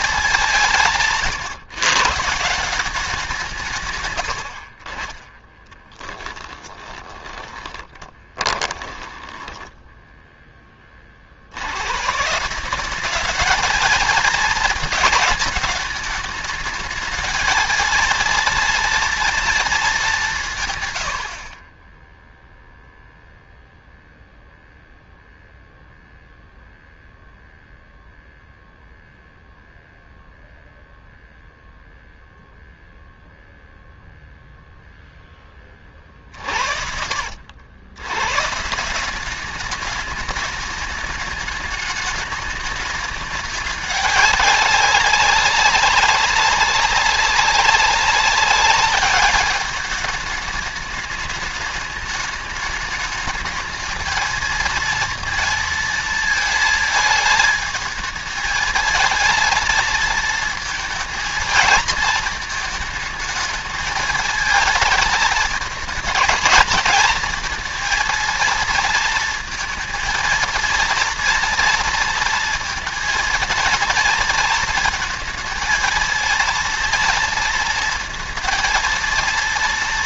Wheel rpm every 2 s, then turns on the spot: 110, 180, 40, 20, 20, 30, 190, 220, 210, 230, 110, 0, 0, 0, 0, 0, 0, 0, 50, 170, 210, 210, 200, 190, 200, 210, 210, 230, 220, 220, 220, 220, 220, 220, 230, 230, 230, 220, 230, 230.
4-10